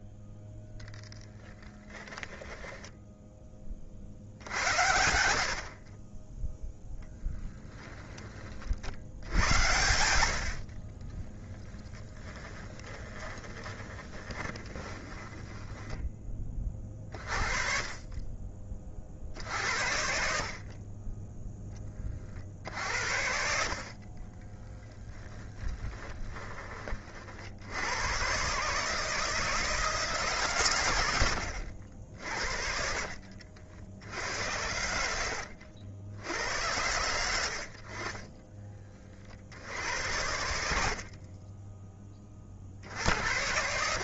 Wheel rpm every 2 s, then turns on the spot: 0, 10, 80, 0, 70, 40, 20, 20, 30, 40, 30, 60, 20, 30, 150, 120, 50, 80, 100, 30, 70, 60.
2-4 10-16 24-26